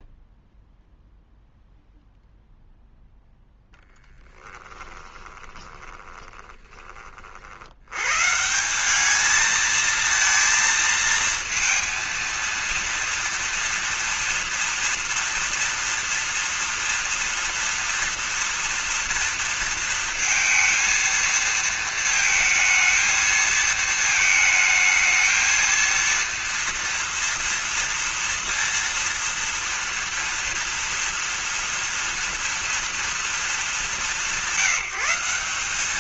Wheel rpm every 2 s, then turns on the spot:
0, 0, 10, 20, 160, 230, 230, 230, 230, 230, 230, 230, 220, 230, 230, 230, 230, 190.
4-8